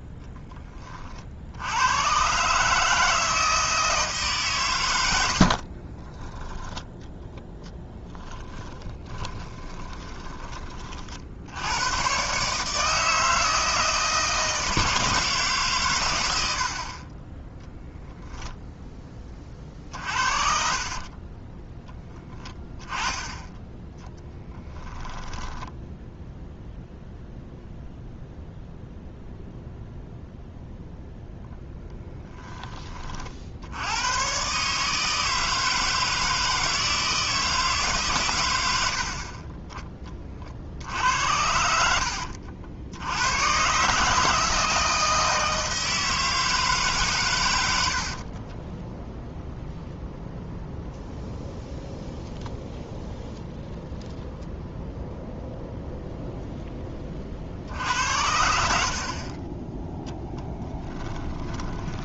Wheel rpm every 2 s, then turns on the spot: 20, 150, 120, 20, 20, 30, 150, 160, 60, 10, 50, 10, 10, 0, 0, 0, 30, 140, 160, 80, 60, 70, 160, 150, 20, 0, 0, 0, 10, 60, 10.
8-10 20-26 48-50 58-62